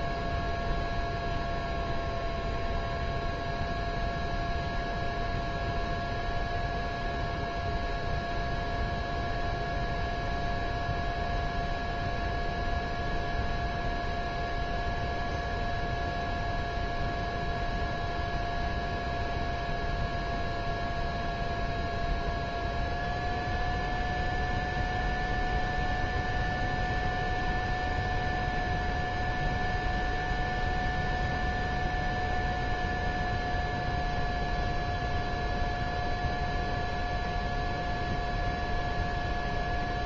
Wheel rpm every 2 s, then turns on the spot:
0, 0, 0, 0, 0, 0, 0, 0, 0, 0, 0, 0, 0, 0, 0, 0, 0, 0, 0, 0.
none